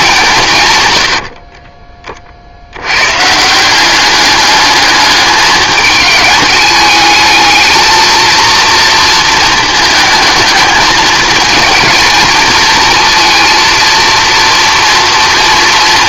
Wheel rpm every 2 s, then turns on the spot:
110, 100, 210, 210, 230, 210, 230, 230.
none